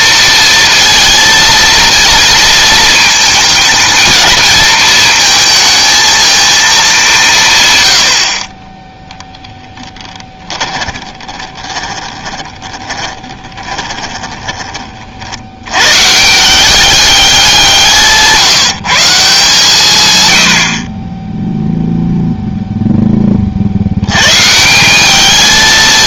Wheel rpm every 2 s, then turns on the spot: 230, 230, 220, 220, 20, 20, 20, 30, 200, 170, 70, 0, 180.
10-14